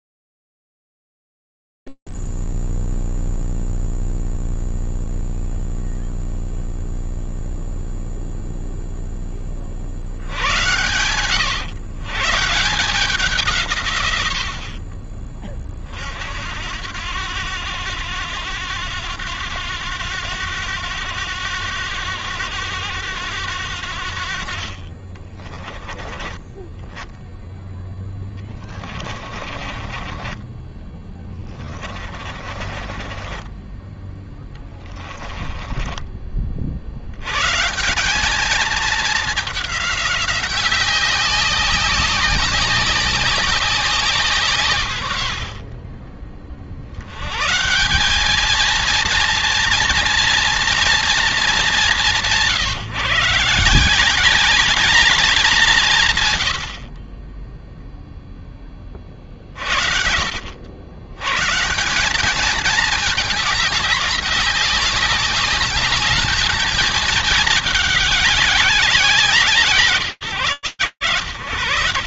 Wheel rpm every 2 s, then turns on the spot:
0, 0, 0, 0, 0, 50, 130, 130, 50, 90, 100, 100, 60, 20, 30, 20, 20, 20, 110, 210, 190, 190, 70, 100, 230, 210, 160, 190, 20, 40, 110, 210, 190, 220, 180, 100.
28-36